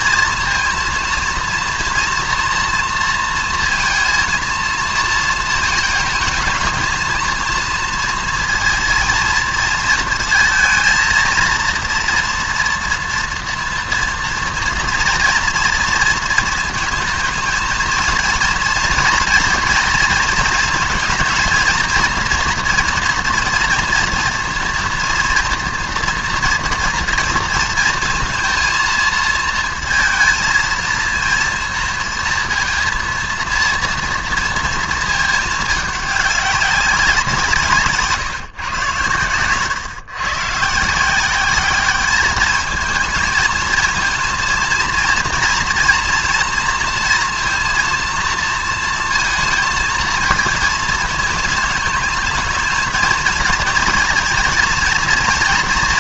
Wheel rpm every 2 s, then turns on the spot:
230, 230, 220, 230, 220, 230, 230, 230, 230, 230, 230, 230, 240, 230, 230, 230, 230, 230, 200, 130, 160, 220, 230, 230, 230, 220, 220, 230.
none